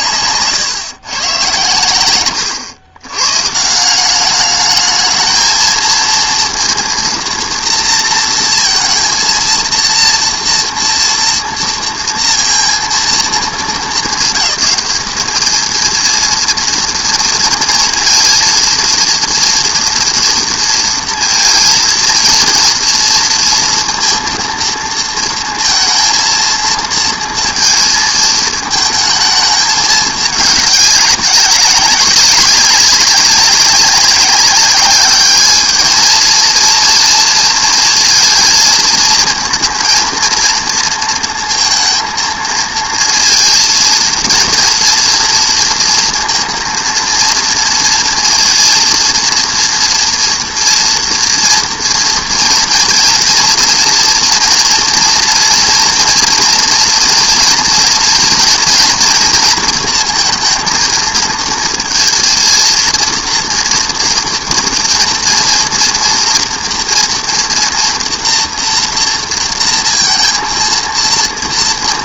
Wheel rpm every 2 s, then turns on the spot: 140, 110, 210, 230, 230, 240, 230, 210, 230, 230, 230, 230, 230, 230, 220, 210, 190, 200, 220, 230, 230, 230, 230, 230, 230, 230, 230, 230, 230, 230, 230, 230, 230, 230, 230, 230.
0-2